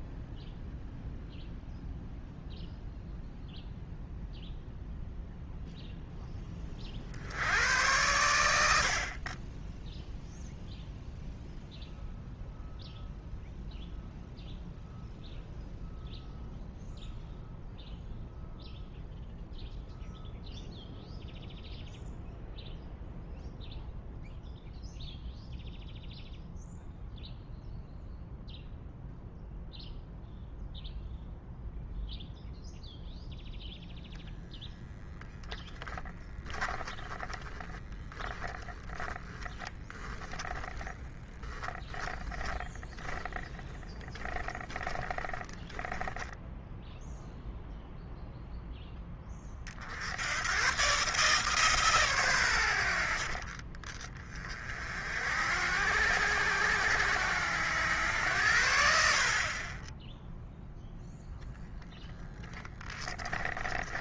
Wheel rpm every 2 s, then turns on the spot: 0, 0, 0, 30, 70, 0, 0, 0, 0, 0, 0, 0, 0, 0, 0, 0, 0, 0, 10, 20, 10, 10, 10, 0, 0, 120, 80, 40, 80, 70, 0, 20.
36-46 62-64